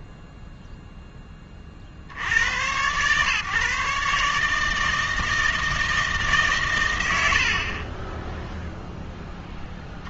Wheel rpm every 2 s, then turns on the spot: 20, 100, 150, 130, 0.
0-2